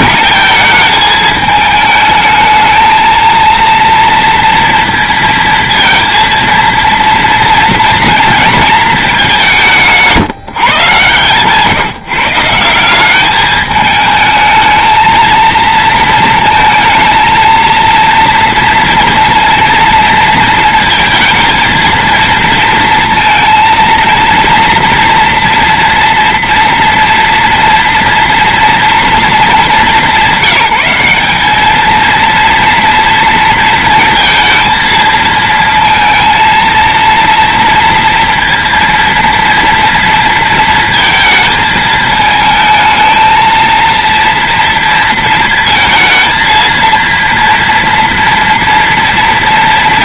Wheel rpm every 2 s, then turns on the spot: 220, 230, 230, 230, 180, 130, 210, 230, 230, 230, 230, 230, 230, 230, 210, 190, 230, 230, 230, 230, 220, 220, 220, 230, 230.
none